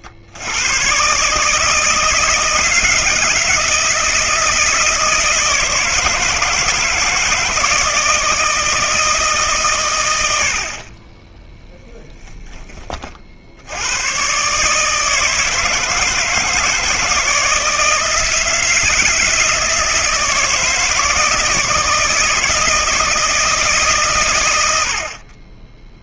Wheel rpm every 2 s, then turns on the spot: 110, 160, 160, 160, 160, 50, 20, 150, 160, 170, 160, 160, 90.
none